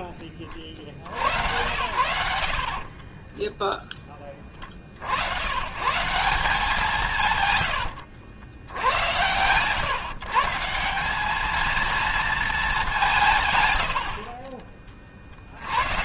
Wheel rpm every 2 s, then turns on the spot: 70, 40, 60, 160, 100, 180, 180, 40.
2-4